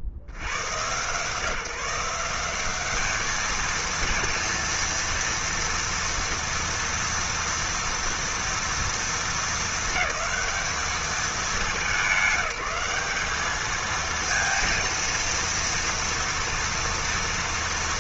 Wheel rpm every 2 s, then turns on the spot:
70, 200, 230, 230, 220, 190, 200, 230, 240.
none